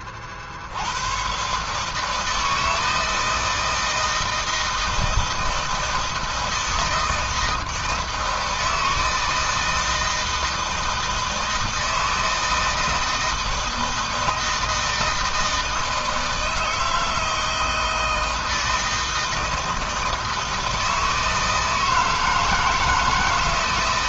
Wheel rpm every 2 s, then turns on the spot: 70, 160, 160, 160, 160, 160, 160, 160, 160, 160, 160, 160.
none